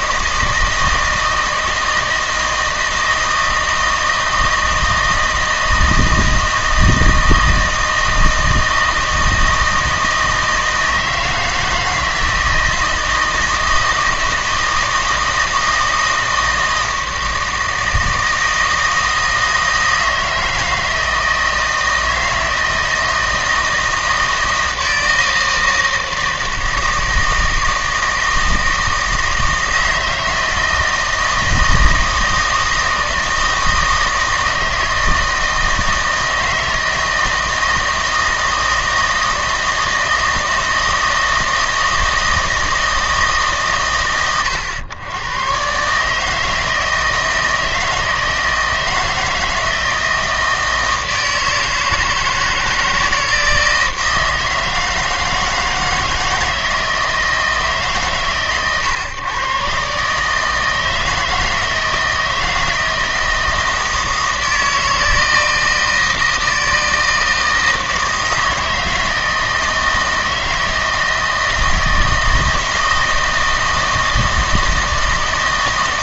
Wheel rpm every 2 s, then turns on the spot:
160, 160, 160, 160, 160, 160, 160, 160, 160, 160, 160, 160, 160, 160, 160, 160, 160, 160, 160, 160, 160, 160, 100, 160, 160, 160, 160, 160, 160, 130, 160, 160, 160, 160, 160, 160, 160, 160.
none